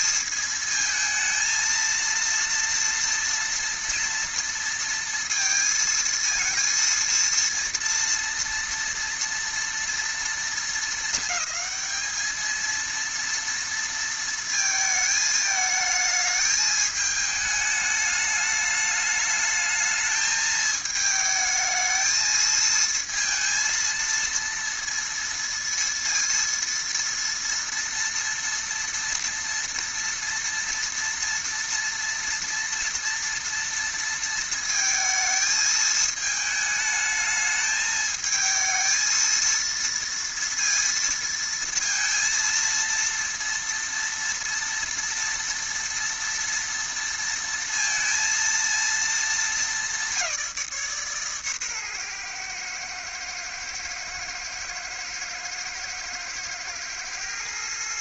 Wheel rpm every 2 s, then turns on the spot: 230, 230, 230, 230, 230, 220, 220, 220, 220, 210, 220, 220, 230, 230, 230, 230, 230, 230, 220, 220, 230, 230, 230, 230, 230, 170, 120, 110, 110.
none